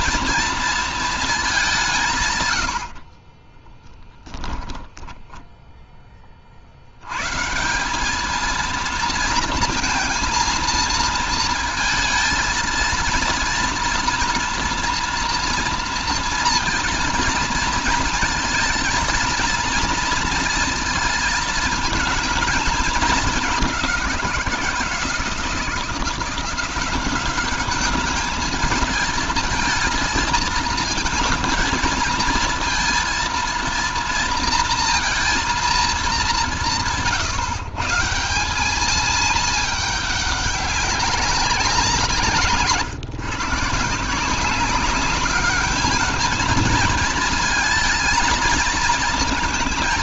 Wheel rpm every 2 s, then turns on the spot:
230, 80, 10, 80, 230, 220, 230, 230, 230, 220, 230, 220, 160, 190, 220, 230, 230, 230, 150, 200, 200, 160, 190, 220, 230.
4-6